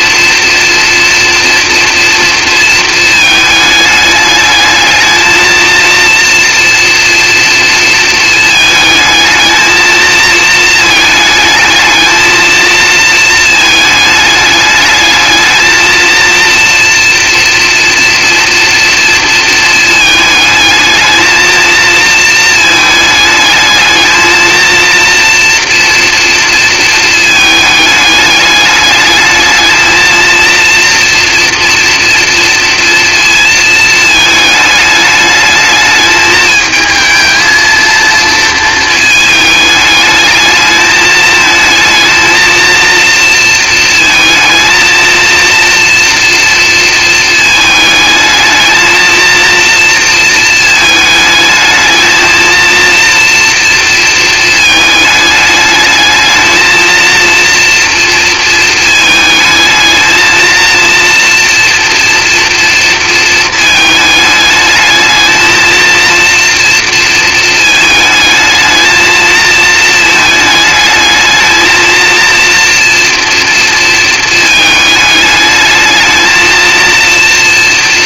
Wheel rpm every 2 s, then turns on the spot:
230, 230, 210, 230, 220, 230, 230, 210, 230, 230, 220, 220, 220, 230, 210, 230, 230, 220, 220, 230, 210, 220, 230, 230, 220, 220, 230, 220, 220, 230, 230, 230, 210, 230, 220, 220, 230, 220, 230.
none